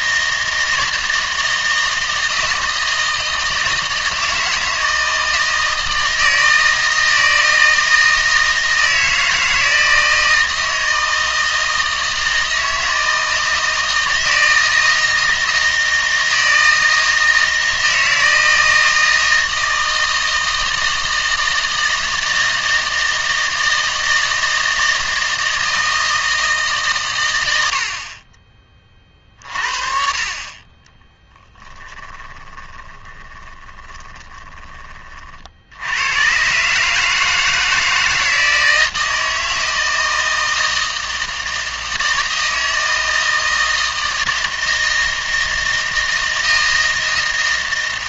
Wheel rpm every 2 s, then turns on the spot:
160, 160, 160, 160, 160, 160, 160, 160, 160, 160, 160, 160, 160, 140, 30, 30, 20, 20, 150, 160, 160, 160, 160, 160.
32-34